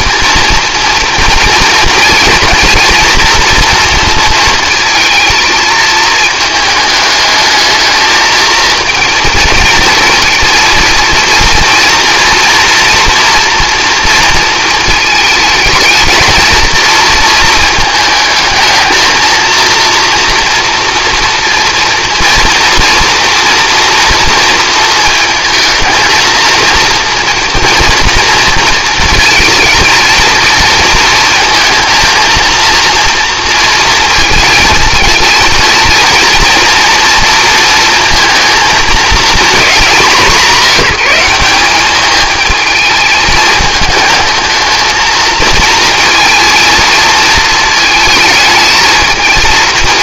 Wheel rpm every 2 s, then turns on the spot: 230, 230, 230, 220, 230, 230, 230, 220, 220, 220, 230, 240, 230, 230, 220, 230, 230, 220, 230, 220, 190, 220, 220, 230, 220.
none